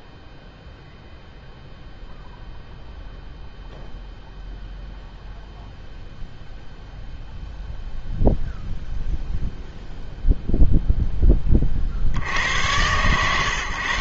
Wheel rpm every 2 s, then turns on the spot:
0, 0, 0, 0, 0, 0, 100.
none